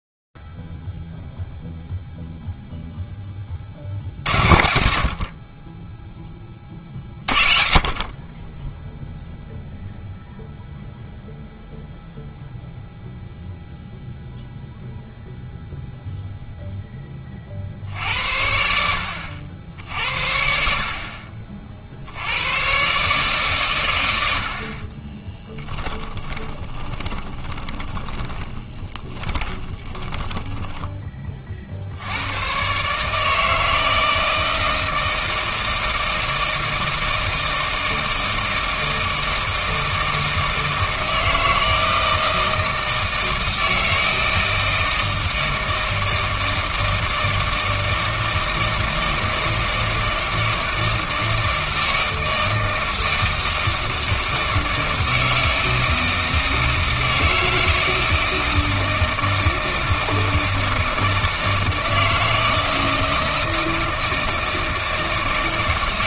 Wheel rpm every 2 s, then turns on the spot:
0, 0, 70, 40, 10, 0, 0, 0, 0, 80, 60, 120, 40, 20, 30, 10, 120, 160, 160, 160, 160, 160, 160, 160, 160, 160, 160, 160, 160, 160, 160, 160, 160.
26-32